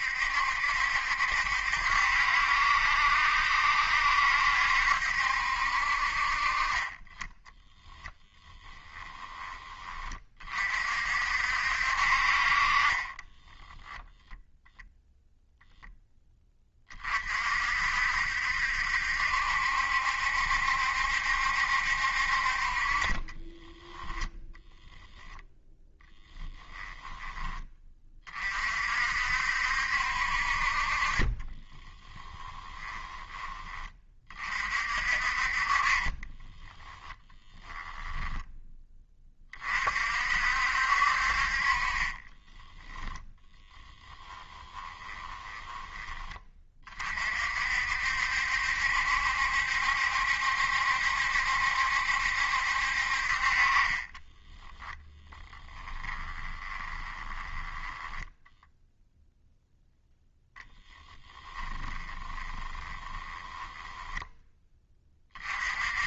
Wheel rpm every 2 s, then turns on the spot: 70, 70, 70, 30, 10, 50, 20, 0, 30, 70, 70, 30, 10, 10, 50, 40, 20, 50, 10, 10, 60, 10, 20, 30, 70, 70, 60, 10, 20, 0, 10, 20, 20.
8-10 24-28 32-34 36-38 42-46 54-58 60-64